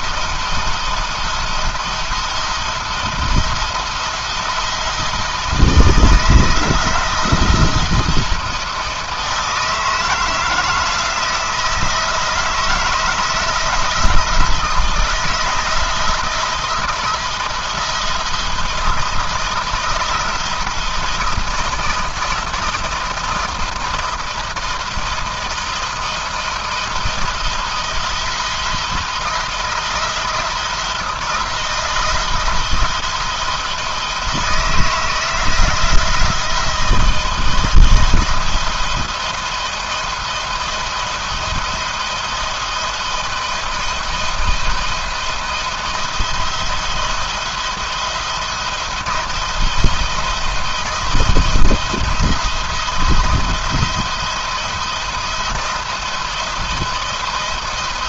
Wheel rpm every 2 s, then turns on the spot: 170, 170, 170, 170, 160, 170, 160, 170, 170, 170, 170, 170, 170, 170, 170, 170, 170, 160, 170, 170, 170, 170, 170, 170, 170, 170, 170, 170, 170.
none